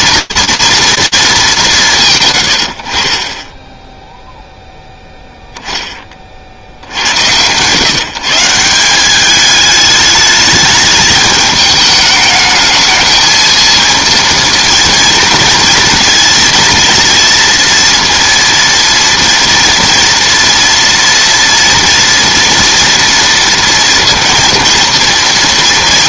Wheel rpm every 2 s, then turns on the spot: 230, 80, 0, 60, 170, 210, 220, 230, 230, 230, 230, 240, 230.
none